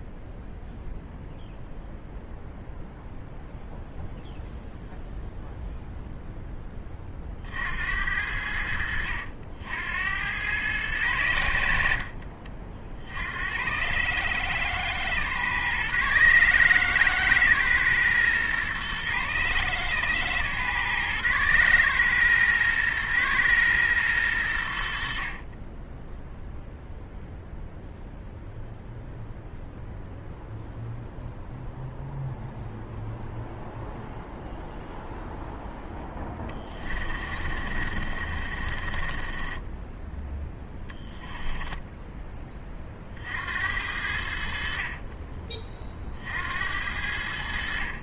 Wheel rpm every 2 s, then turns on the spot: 0, 0, 0, 10, 70, 100, 50, 120, 110, 120, 120, 120, 80, 0, 0, 0, 0, 0, 20, 40, 10, 30, 50, 70.
36-42